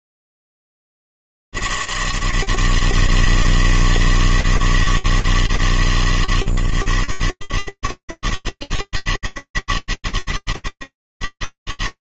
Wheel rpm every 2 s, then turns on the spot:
80, 160, 160, 130, 150, 160.
none